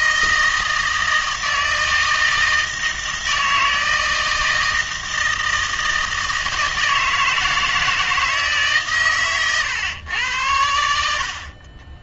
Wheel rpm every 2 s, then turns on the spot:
160, 160, 160, 160, 140, 80.
none